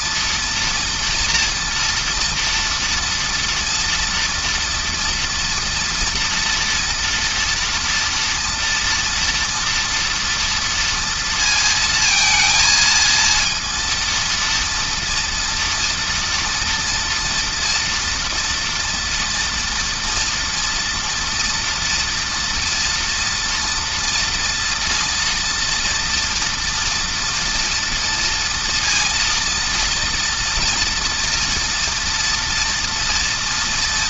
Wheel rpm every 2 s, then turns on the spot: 230, 230, 230, 230, 240, 230, 230, 230, 230, 230, 230, 230, 230, 230, 230, 230, 240.
none